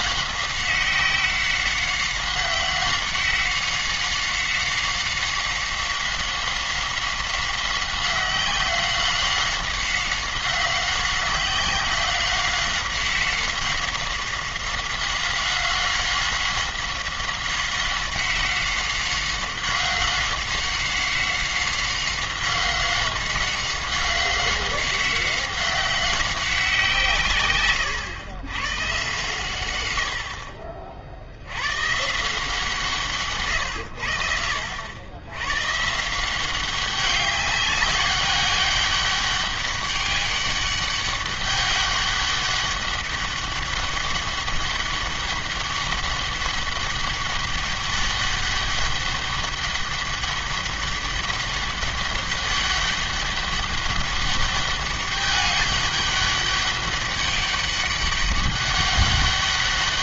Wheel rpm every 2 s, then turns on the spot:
190, 190, 190, 190, 190, 190, 190, 190, 190, 190, 190, 190, 190, 170, 120, 50, 160, 80, 190, 200, 200, 200, 200, 200, 200, 200, 200, 200, 200, 200.
none